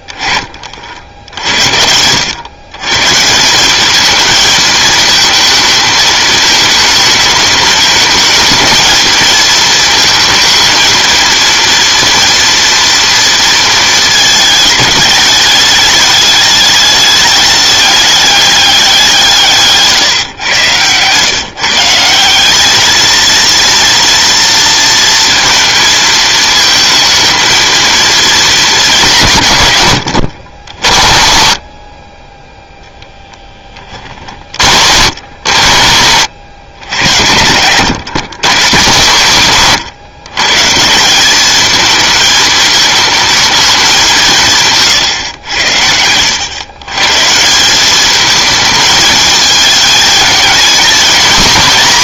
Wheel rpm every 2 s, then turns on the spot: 30, 110, 220, 220, 220, 230, 230, 220, 210, 200, 120, 200, 230, 230, 220, 70, 10, 60, 90, 130, 150, 220, 150, 110, 220, 220.
20-22 44-46